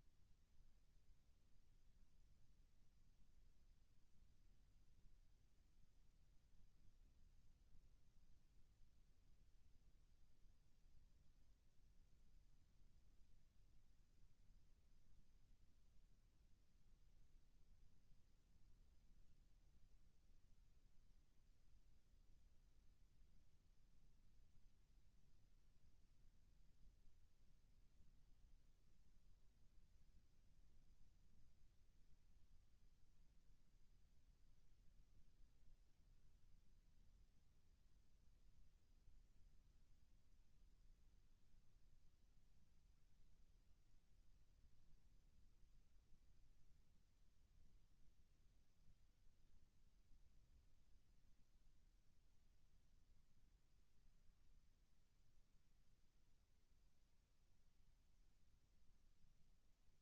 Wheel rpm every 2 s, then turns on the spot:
0, 0, 0, 0, 0, 0, 0, 0, 0, 0, 0, 0, 0, 0, 0, 0, 0, 0, 0, 0, 0, 0, 0, 0, 0, 0, 0, 0, 0, 0.
none